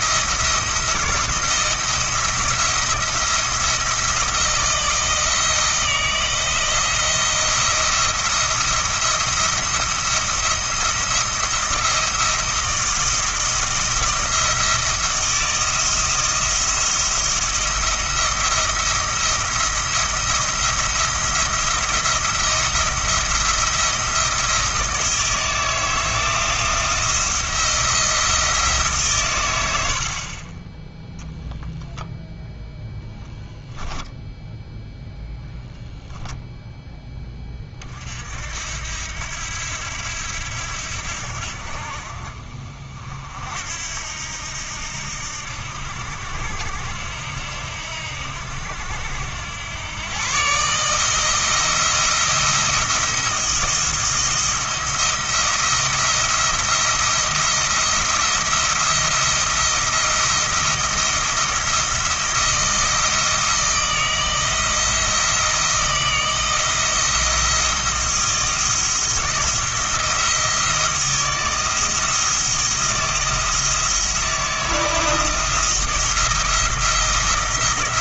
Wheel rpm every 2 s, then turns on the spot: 170, 170, 160, 170, 170, 170, 170, 170, 170, 170, 170, 170, 160, 160, 160, 20, 0, 0, 0, 70, 80, 50, 80, 80, 80, 140, 170, 170, 170, 160, 170, 170, 160, 160, 170, 160, 160, 160, 170.
30-32